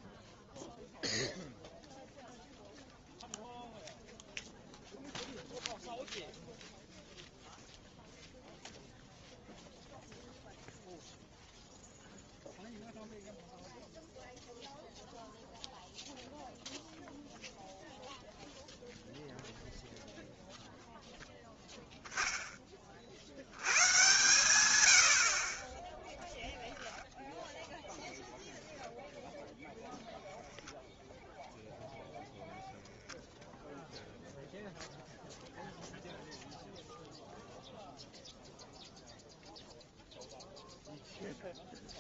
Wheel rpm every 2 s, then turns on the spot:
0, 0, 0, 0, 0, 0, 0, 0, 0, 0, 0, 50, 70, 0, 10, 0, 0, 0, 0, 0, 0.
none